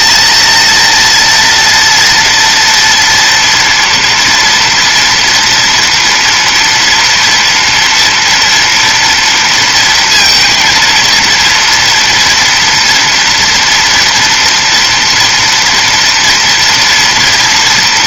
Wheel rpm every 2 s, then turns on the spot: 230, 230, 230, 230, 230, 230, 240, 240, 230.
none